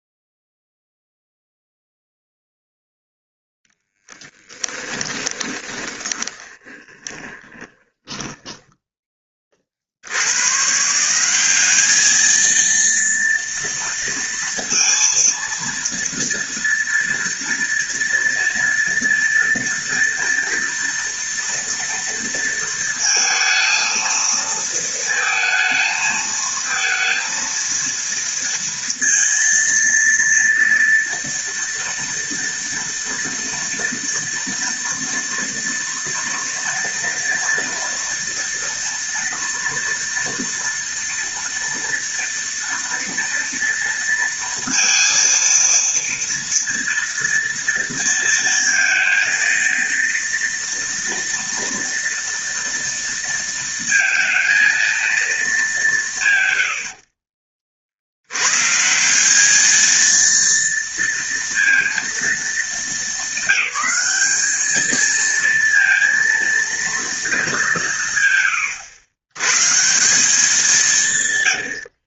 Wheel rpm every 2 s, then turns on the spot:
0, 0, 10, 20, 20, 180, 230, 230, 230, 230, 230, 230, 220, 230, 230, 230, 230, 230, 230, 230, 230, 230, 230, 230, 230, 230, 230, 220, 60, 180, 230, 220, 220, 210, 110, 130.
4-8